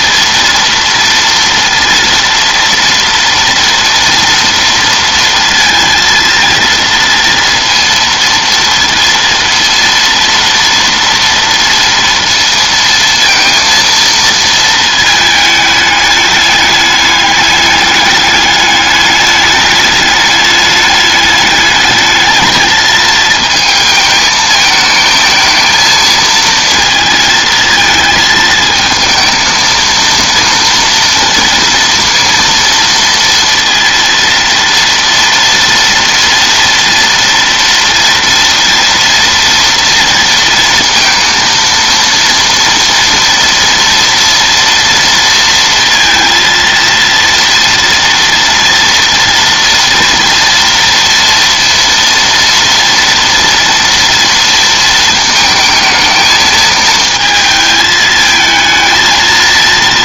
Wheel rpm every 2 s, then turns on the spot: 230, 230, 230, 230, 230, 230, 230, 220, 210, 210, 210, 220, 220, 230, 220, 230, 230, 230, 230, 230, 230, 230, 230, 230, 240, 230, 230, 230, 220, 220.
none